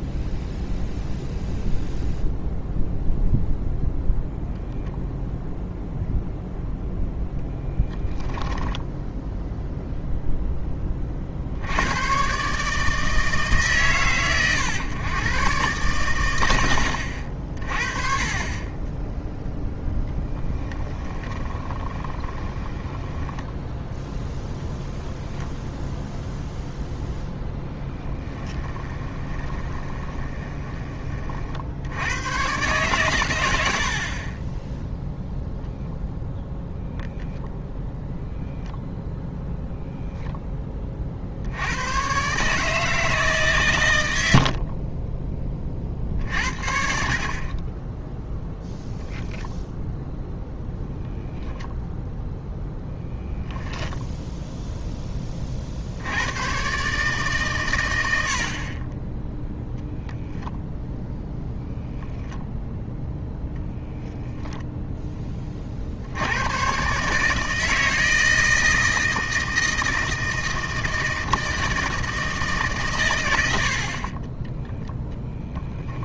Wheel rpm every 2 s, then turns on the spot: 0, 0, 0, 0, 10, 10, 140, 120, 80, 20, 10, 10, 10, 0, 20, 20, 130, 10, 0, 0, 20, 150, 40, 60, 0, 0, 0, 0, 130, 40, 0, 0, 0, 120, 160, 160, 140, 10.
8-10 20-24 28-30 44-46